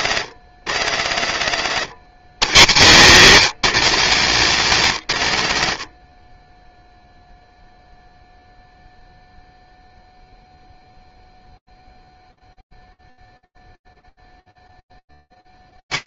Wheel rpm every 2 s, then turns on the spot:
170, 130, 180, 30, 0, 0, 0, 0.
none